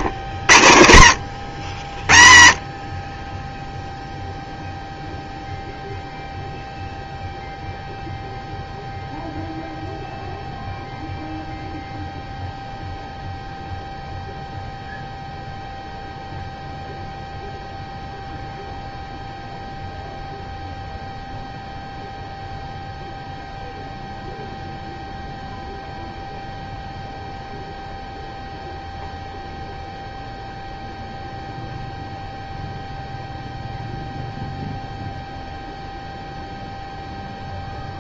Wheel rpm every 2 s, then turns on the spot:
80, 30, 0, 0, 0, 0, 0, 0, 0, 0, 0, 0, 0, 0, 0, 0, 0, 0, 0.
none